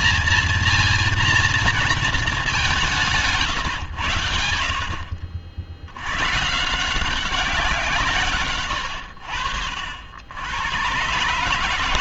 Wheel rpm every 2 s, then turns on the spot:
230, 210, 80, 130, 120, 90.
none